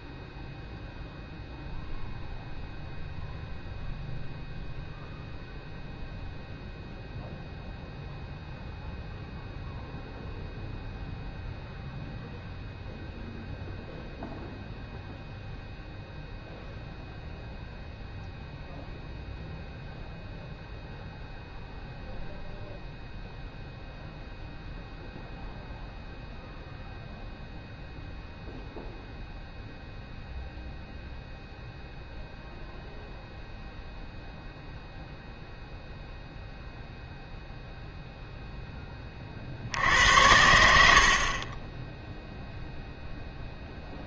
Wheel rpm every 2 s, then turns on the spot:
0, 0, 0, 0, 0, 0, 0, 0, 0, 0, 0, 0, 0, 0, 0, 0, 0, 0, 0, 0, 80, 0.
none